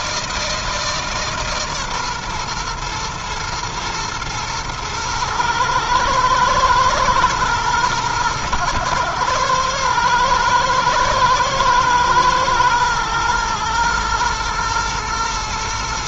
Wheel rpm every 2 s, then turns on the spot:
160, 120, 120, 110, 110, 120, 120, 110.
none